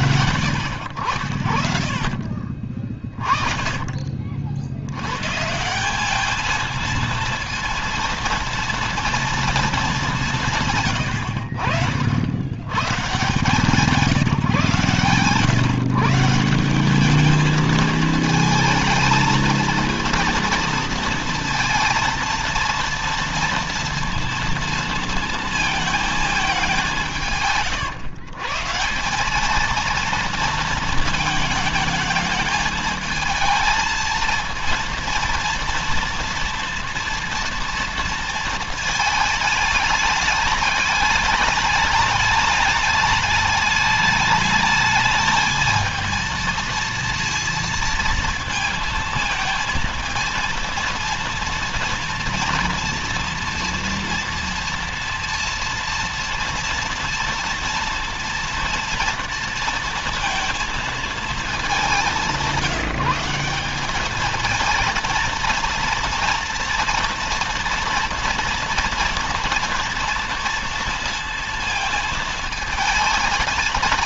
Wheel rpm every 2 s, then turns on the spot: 70, 30, 80, 220, 230, 140, 110, 140, 190, 230, 240, 230, 230, 180, 160, 230, 220, 230, 230, 220, 210, 210, 210, 230, 230, 230, 230, 230, 230, 230, 230, 190, 220, 230, 230, 230, 220.
none